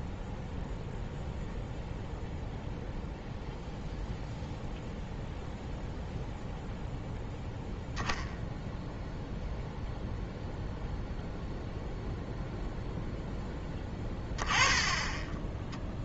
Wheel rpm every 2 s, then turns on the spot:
0, 0, 0, 0, 0, 0, 0, 10.
none